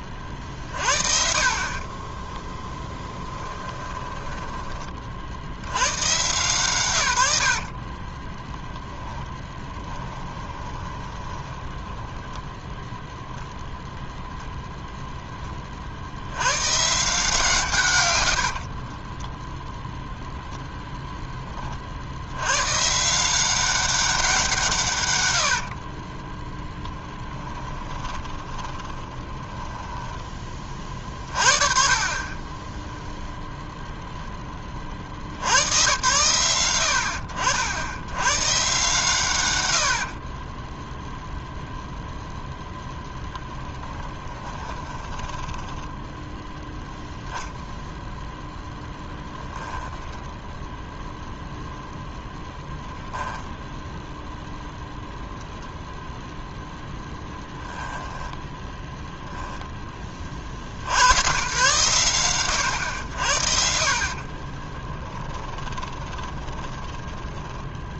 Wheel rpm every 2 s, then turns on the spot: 40, 20, 20, 150, 10, 20, 10, 0, 120, 50, 0, 120, 150, 10, 20, 30, 10, 30, 70, 130, 10, 0, 20, 0, 0, 0, 0, 0, 0, 10, 60, 100, 30, 20.
2-6 8-12 18-20 28-30 40-42 44-46 58-60 64-68